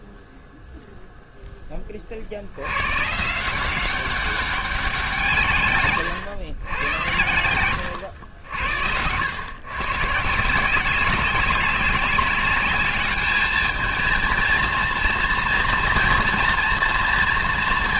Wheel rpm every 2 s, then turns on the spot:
0, 100, 190, 110, 80, 170, 210, 230, 230.
8-10